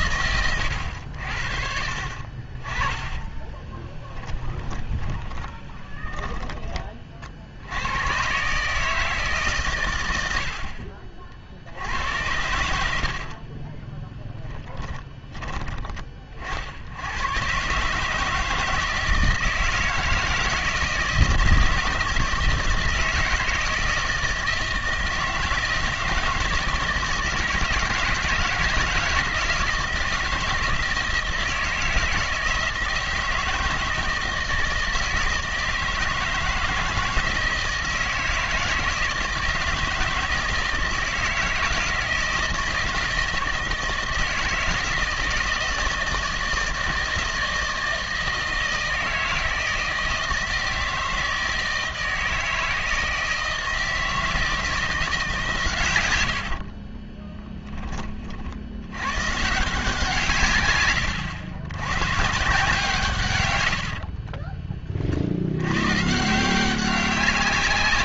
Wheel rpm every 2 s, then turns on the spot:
90, 20, 10, 30, 150, 50, 70, 20, 90, 160, 160, 160, 160, 160, 170, 160, 160, 160, 160, 160, 160, 160, 160, 160, 160, 160, 160, 160, 40, 100, 110, 150, 40, 190.
4-6 12-14 56-58